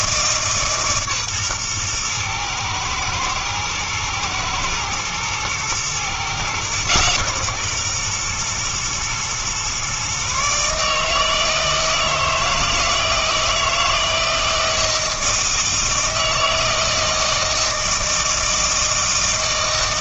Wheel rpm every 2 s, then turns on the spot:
150, 120, 120, 130, 120, 140, 160, 160, 160, 160.
none